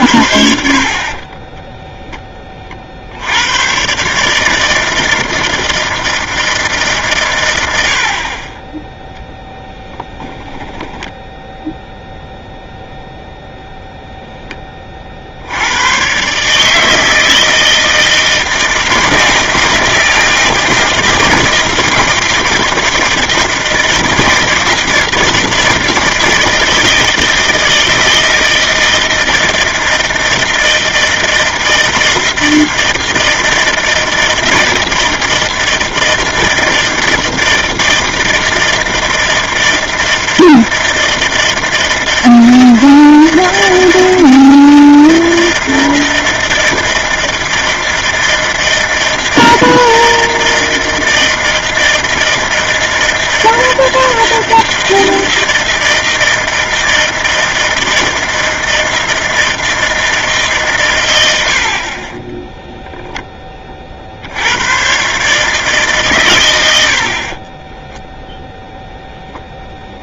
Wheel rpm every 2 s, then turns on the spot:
50, 10, 140, 160, 40, 0, 0, 0, 130, 160, 160, 160, 160, 160, 160, 160, 160, 160, 160, 160, 160, 160, 160, 160, 160, 160, 160, 160, 160, 160, 150, 20, 70, 120, 0.
none